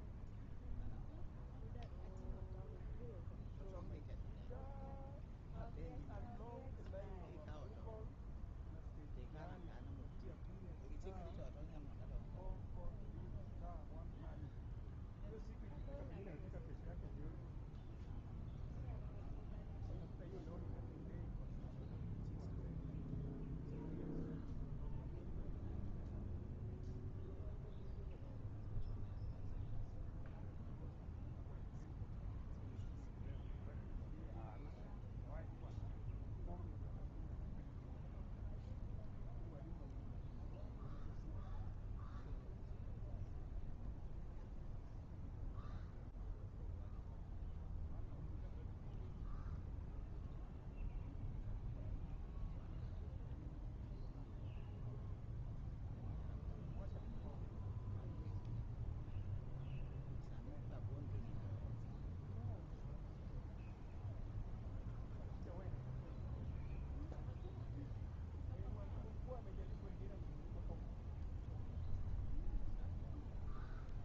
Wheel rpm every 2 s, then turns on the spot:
0, 0, 0, 0, 0, 0, 0, 0, 0, 0, 0, 0, 0, 0, 0, 0, 0, 0, 0, 0, 0, 0, 0, 0, 0, 0, 0, 0, 0, 0, 0, 0, 0, 0, 0, 0, 0.
none